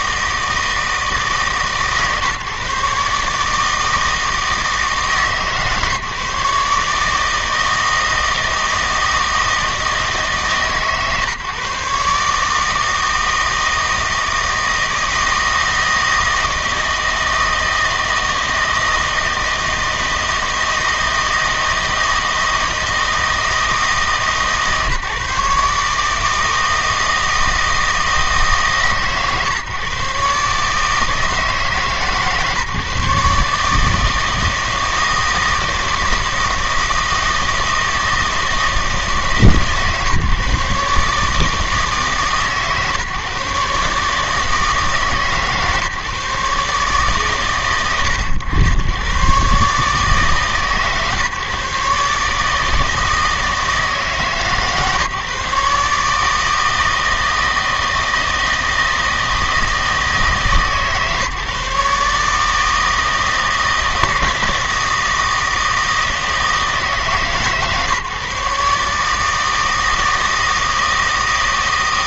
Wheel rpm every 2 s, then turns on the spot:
160, 140, 160, 150, 160, 150, 150, 160, 160, 160, 160, 160, 150, 160, 150, 150, 150, 160, 160, 160, 150, 140, 150, 140, 100, 150, 160, 150, 160, 160, 150, 150, 160, 160, 150, 160.
none